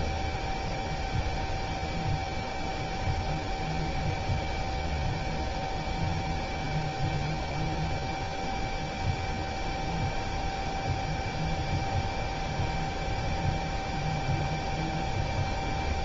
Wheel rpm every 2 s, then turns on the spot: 0, 0, 0, 0, 0, 0, 0, 0.
none